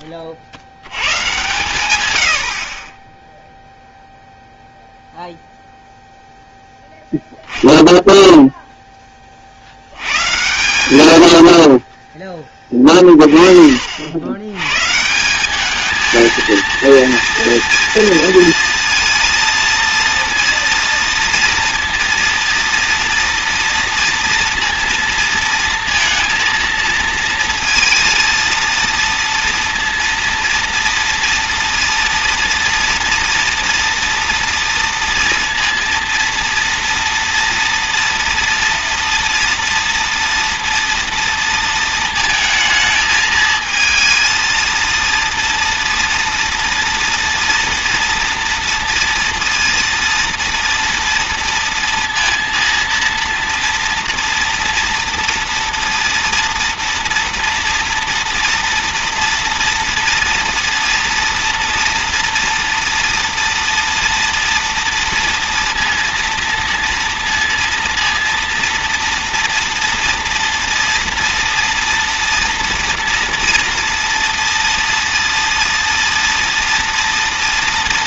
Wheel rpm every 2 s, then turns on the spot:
120, 10, 0, 10, 20, 90, 30, 160, 230, 230, 230, 240, 230, 230, 230, 230, 230, 230, 230, 230, 230, 220, 230, 230, 230, 230, 230, 230, 230, 230, 240, 230, 230, 230, 230, 230, 230, 230, 230.
none